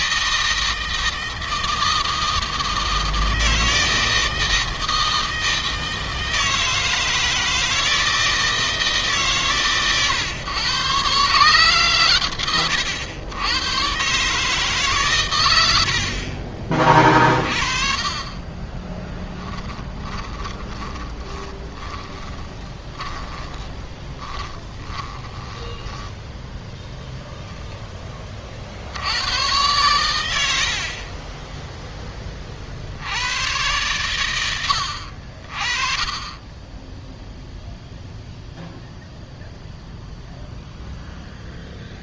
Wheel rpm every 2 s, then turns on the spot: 160, 160, 160, 160, 150, 140, 100, 140, 30, 20, 20, 20, 20, 0, 90, 30, 80, 50, 10, 0, 0.
18-26 30-32